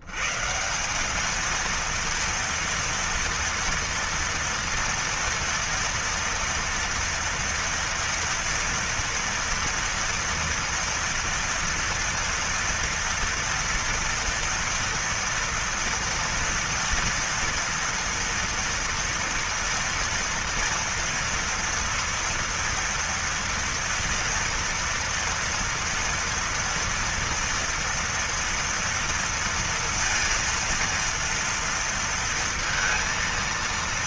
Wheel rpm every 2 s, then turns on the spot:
100, 230, 230, 230, 230, 230, 230, 230, 230, 230, 230, 230, 230, 230, 230, 230, 230.
none